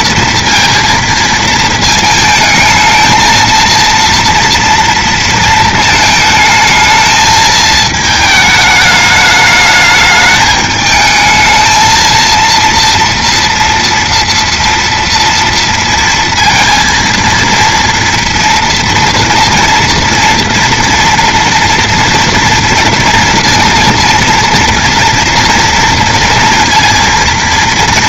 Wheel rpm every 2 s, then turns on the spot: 230, 220, 230, 220, 210, 210, 230, 230, 230, 230, 230, 230, 240, 230.
none